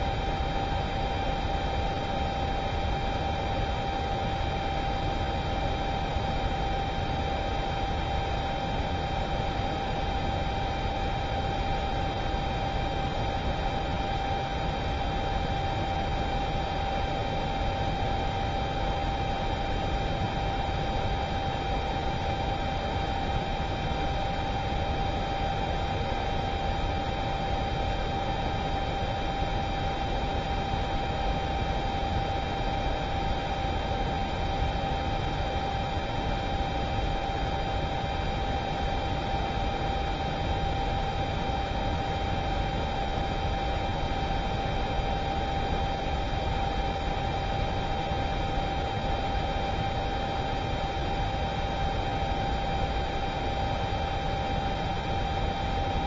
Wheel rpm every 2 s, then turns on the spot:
0, 0, 0, 0, 0, 0, 0, 0, 0, 0, 0, 0, 0, 0, 0, 0, 0, 0, 0, 0, 0, 0, 0, 0, 0, 0, 0, 0.
none